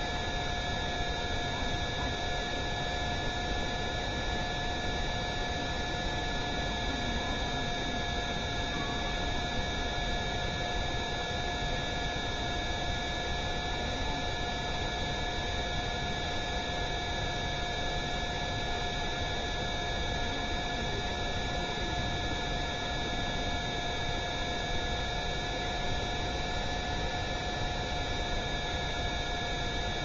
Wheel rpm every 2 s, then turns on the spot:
0, 0, 0, 0, 0, 0, 0, 0, 0, 0, 0, 0, 0, 0, 0.
none